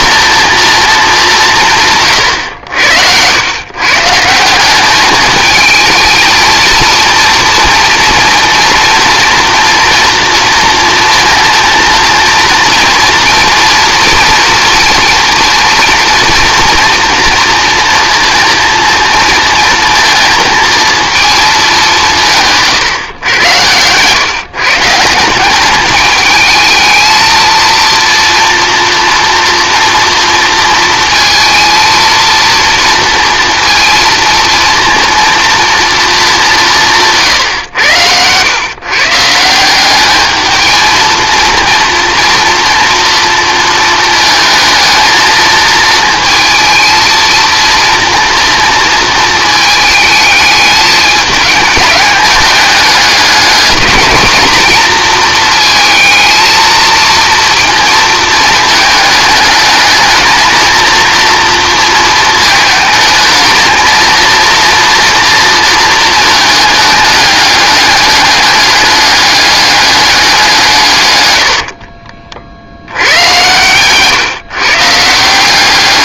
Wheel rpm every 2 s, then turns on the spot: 230, 90, 190, 230, 230, 230, 230, 230, 230, 230, 230, 150, 160, 220, 240, 230, 230, 230, 190, 130, 220, 230, 230, 230, 230, 210, 210, 230, 220, 220, 230, 220, 240, 220, 200, 150, 80, 150.
none